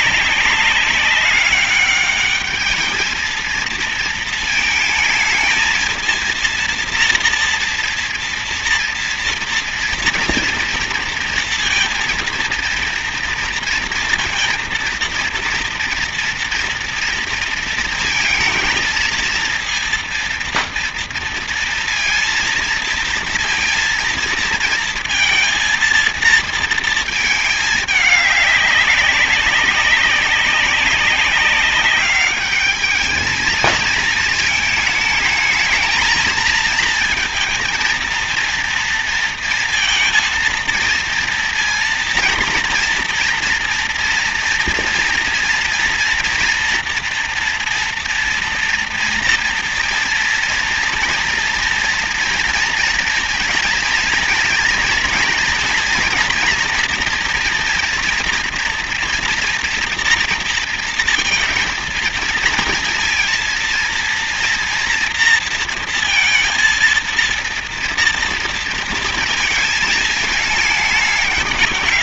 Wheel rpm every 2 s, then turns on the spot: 200, 220, 220, 230, 230, 230, 230, 230, 230, 230, 230, 230, 230, 220, 200, 190, 210, 220, 230, 230, 230, 230, 230, 230, 230, 230, 230, 230, 230, 240, 230, 230, 230, 230, 230, 210.
none